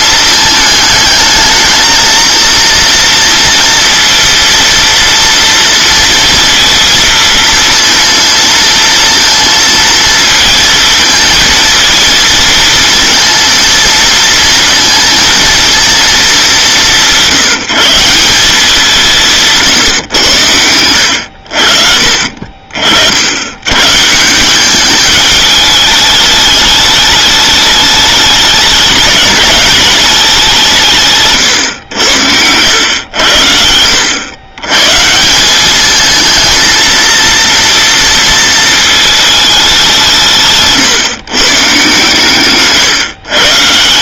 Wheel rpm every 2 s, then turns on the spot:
220, 230, 230, 230, 230, 220, 220, 230, 200, 190, 100, 40, 190, 210, 210, 180, 90, 110, 220, 230, 150, 130.
none